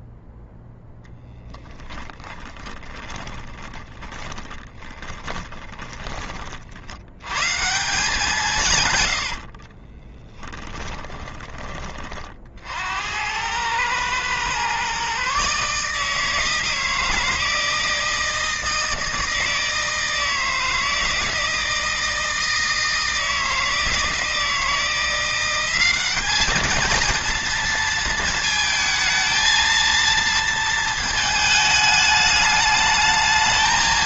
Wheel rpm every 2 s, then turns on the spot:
0, 20, 30, 70, 130, 10, 70, 130, 160, 160, 160, 160, 170, 220, 220, 230, 220.
2-6 10-12